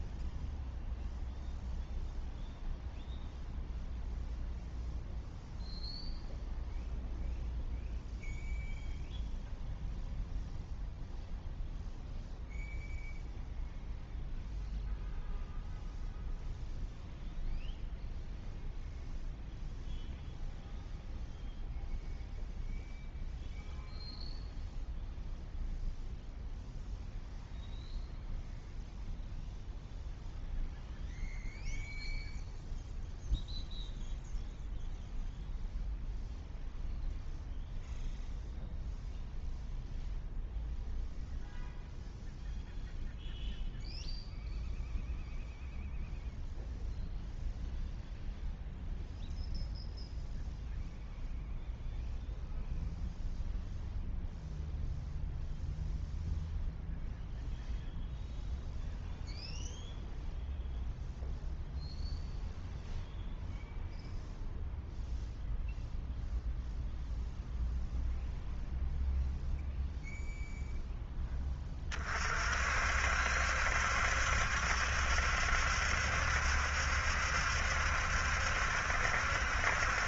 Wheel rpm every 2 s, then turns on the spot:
0, 0, 0, 0, 0, 0, 0, 0, 0, 0, 0, 0, 0, 0, 0, 0, 0, 0, 0, 0, 0, 0, 0, 0, 0, 0, 0, 0, 0, 0, 0, 0, 0, 0, 0, 0, 60, 70, 70, 70.
none